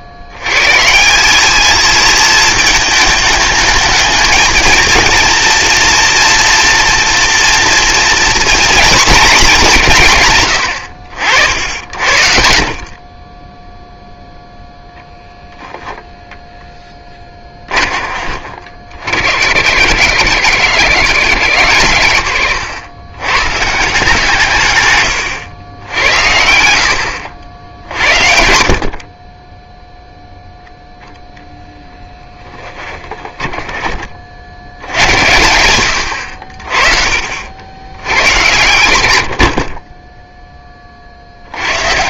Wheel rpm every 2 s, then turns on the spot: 80, 220, 220, 230, 230, 80, 60, 0, 10, 50, 120, 110, 140, 80, 60, 0, 10, 70, 50, 90, 30.
24-26 32-34